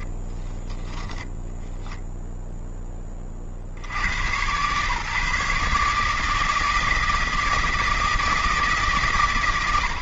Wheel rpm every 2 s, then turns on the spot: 10, 0, 120, 160, 160.
0-2